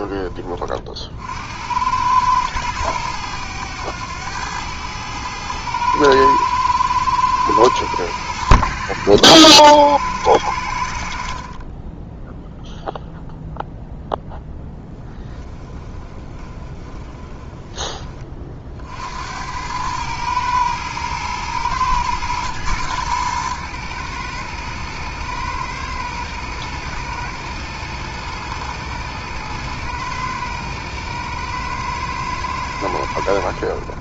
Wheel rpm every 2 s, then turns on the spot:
40, 110, 110, 110, 80, 60, 0, 10, 20, 60, 110, 110, 110, 110, 110, 110, 90.
14-18